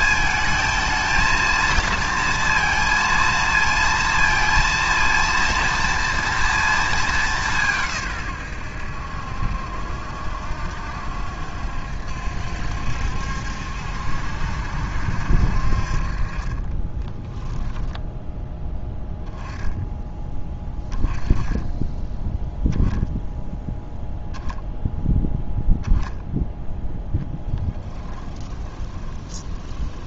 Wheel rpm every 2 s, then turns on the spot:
220, 230, 230, 220, 90, 70, 70, 70, 20, 10, 10, 0, 0, 0, 20.
16-18 28-30